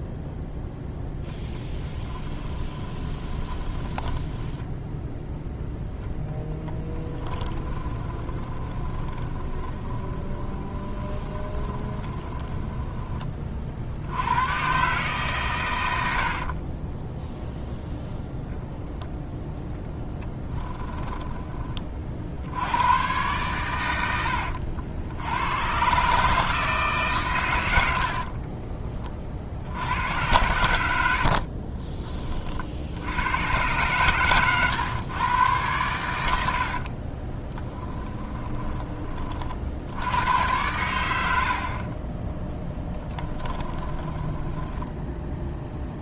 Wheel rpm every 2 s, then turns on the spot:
10, 30, 20, 10, 20, 20, 20, 120, 30, 0, 10, 90, 60, 150, 30, 80, 50, 120, 50, 20, 100, 10, 10.
2-14 16-18 20-22 36-38 42-46